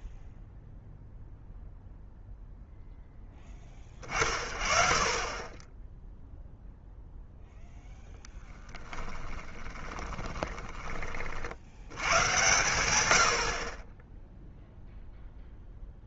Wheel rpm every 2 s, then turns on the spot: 0, 0, 40, 0, 10, 20, 110, 0.
8-12